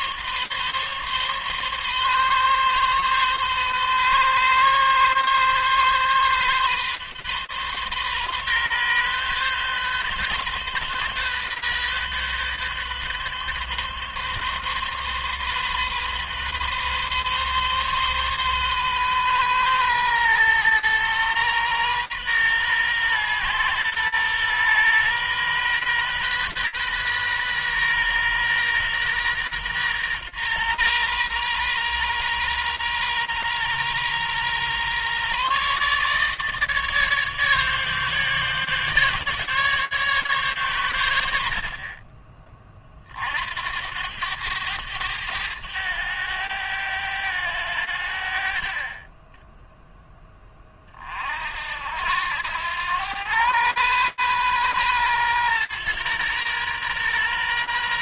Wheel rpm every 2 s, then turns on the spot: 140, 140, 130, 130, 130, 130, 130, 140, 130, 130, 120, 120, 120, 130, 120, 120, 120, 130, 150, 150, 110, 40, 100, 100, 30, 40, 100, 120, 120.
none